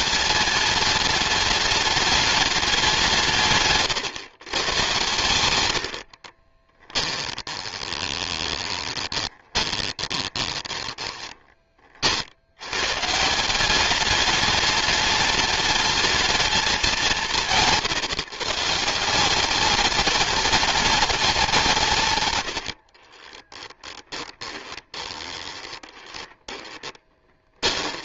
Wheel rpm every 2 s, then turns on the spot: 210, 200, 120, 10, 20, 20, 120, 210, 200, 160, 210, 70, 20, 20.
6-12 22-28